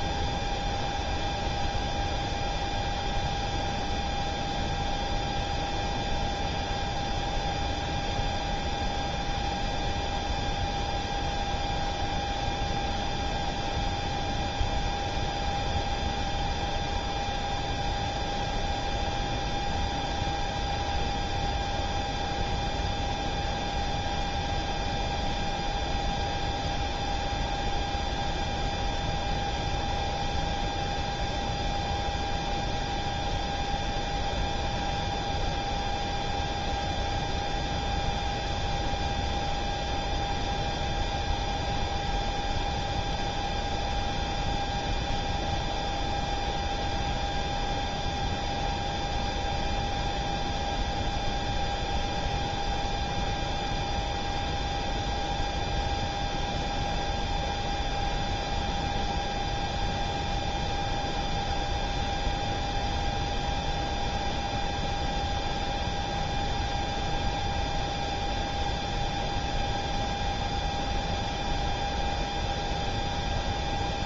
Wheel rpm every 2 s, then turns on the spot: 0, 0, 0, 0, 0, 0, 0, 0, 0, 0, 0, 0, 0, 0, 0, 0, 0, 0, 0, 0, 0, 0, 0, 0, 0, 0, 0, 0, 0, 0, 0, 0, 0, 0, 0, 0, 0.
none